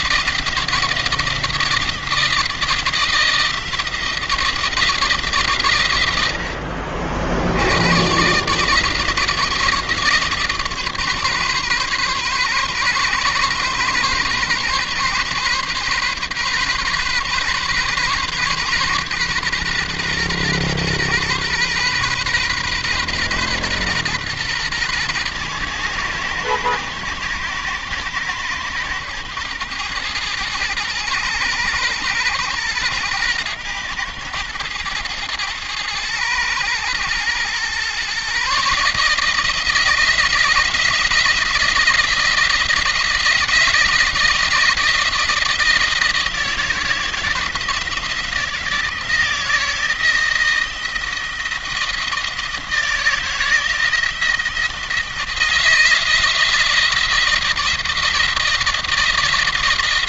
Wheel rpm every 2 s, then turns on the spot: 160, 160, 170, 70, 150, 150, 130, 130, 130, 130, 120, 130, 120, 120, 110, 120, 110, 110, 110, 150, 160, 170, 170, 170, 170, 170, 160, 170, 170, 170.
none